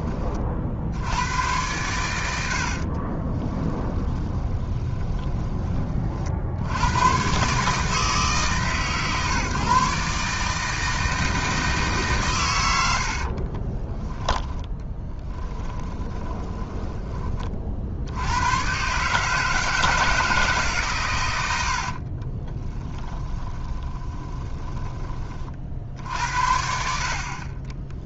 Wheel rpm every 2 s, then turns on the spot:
80, 40, 10, 110, 140, 160, 60, 10, 20, 140, 120, 10, 20, 50.
2-6 12-16 22-24